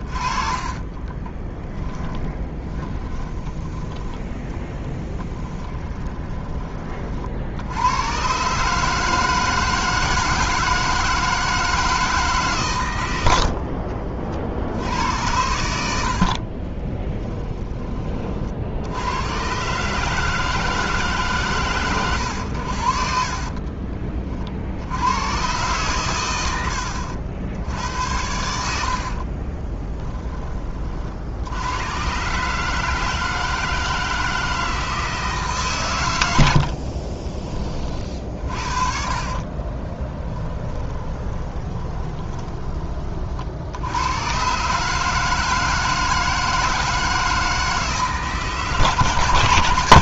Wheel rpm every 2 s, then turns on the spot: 30, 20, 10, 30, 150, 160, 130, 70, 20, 70, 150, 70, 70, 90, 80, 40, 150, 160, 60, 50, 10, 20, 140, 160, 150.
0-6 16-18 26-30 36-42